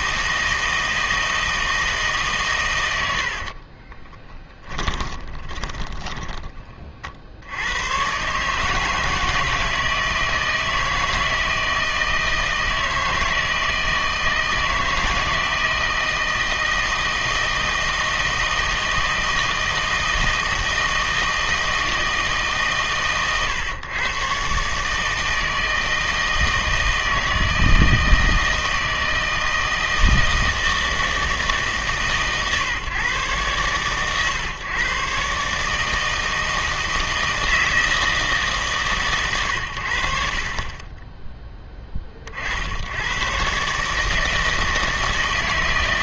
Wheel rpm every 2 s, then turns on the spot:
160, 120, 20, 20, 140, 160, 160, 160, 160, 160, 160, 140, 140, 160, 160, 160, 140, 120, 160, 150, 30, 70, 160.
4-6